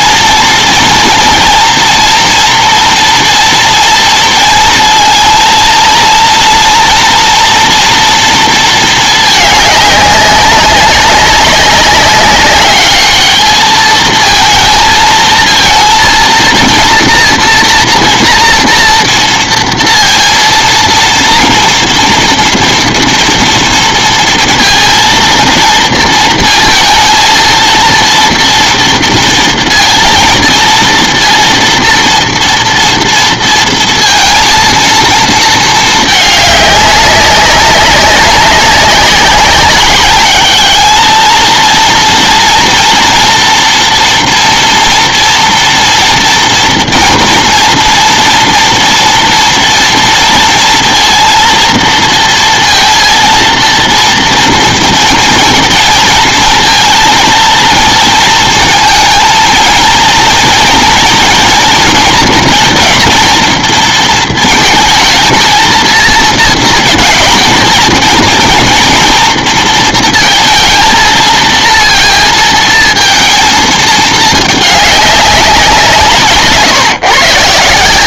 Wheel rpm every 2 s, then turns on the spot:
230, 230, 230, 240, 230, 200, 200, 220, 230, 230, 230, 230, 230, 230, 230, 230, 230, 230, 200, 200, 210, 230, 230, 230, 230, 230, 230, 230, 230, 230, 230, 230, 220, 220, 230, 230, 230, 210, 150.
none